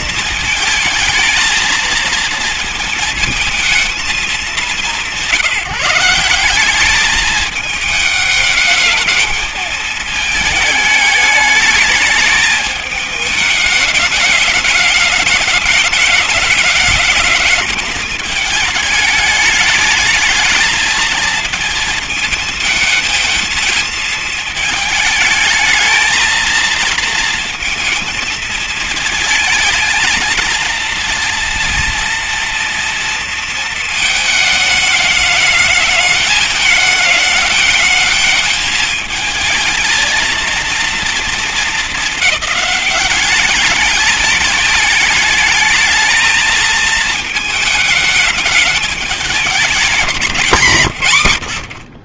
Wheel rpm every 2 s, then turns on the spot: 220, 230, 190, 190, 210, 220, 210, 210, 210, 210, 220, 220, 220, 220, 230, 230, 230, 220, 210, 220, 230, 210, 210, 220, 210, 170.
none